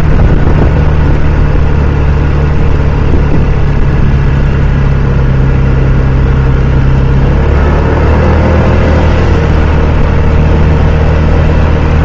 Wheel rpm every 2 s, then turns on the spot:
0, 0, 0, 0, 0, 0.
none